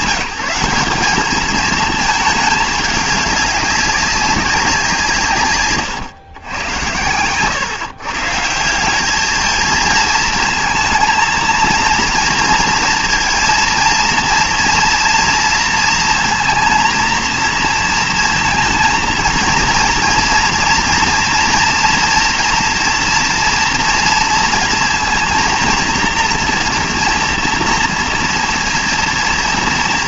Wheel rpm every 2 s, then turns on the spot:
190, 220, 190, 110, 170, 230, 230, 230, 230, 230, 230, 230, 230, 240, 230.
none